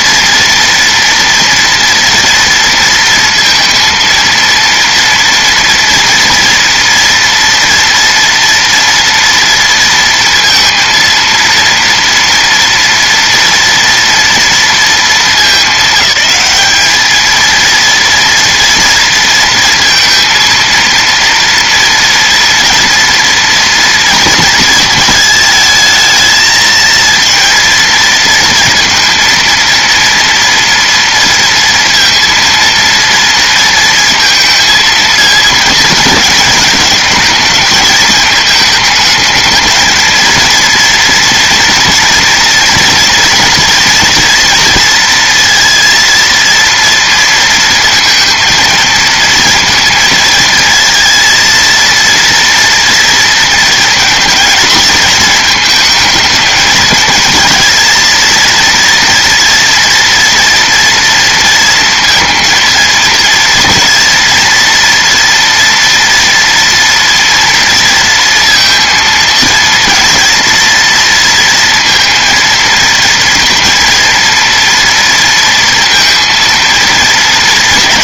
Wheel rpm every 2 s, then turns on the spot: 230, 230, 230, 230, 230, 230, 230, 230, 210, 230, 230, 230, 220, 220, 230, 230, 230, 220, 210, 210, 230, 230, 240, 230, 230, 230, 230, 220, 220, 230, 230, 230, 230, 230, 230, 230, 230, 230, 230.
none